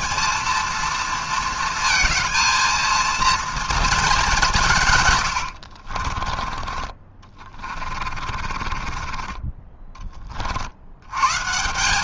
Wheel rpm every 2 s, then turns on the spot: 230, 230, 180, 20, 30, 50.
8-10